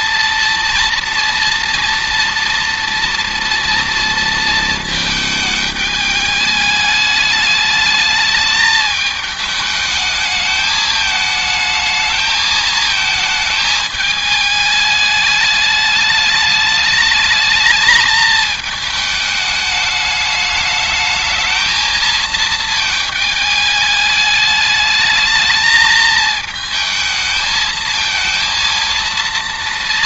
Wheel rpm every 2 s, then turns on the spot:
230, 230, 210, 210, 220, 220, 220, 210, 210, 210, 220, 210, 220, 220, 230.
none